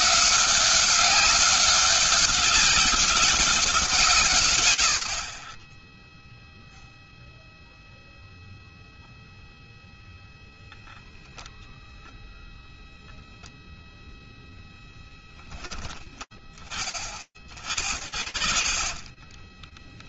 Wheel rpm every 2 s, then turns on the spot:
160, 200, 140, 0, 0, 0, 0, 0, 30, 30.
18-20